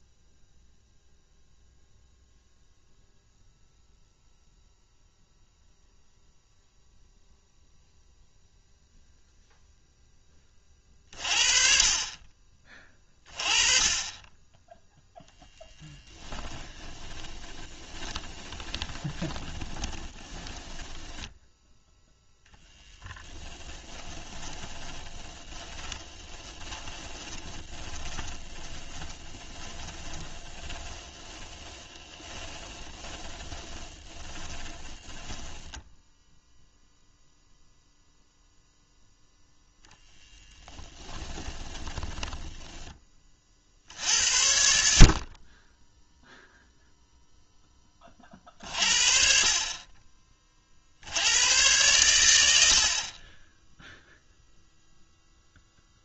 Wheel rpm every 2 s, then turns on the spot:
0, 0, 0, 0, 0, 30, 30, 10, 20, 20, 10, 0, 20, 10, 20, 20, 30, 20, 0, 0, 10, 10, 50, 0, 40, 70, 50, 0.
16-22 24-36 40-42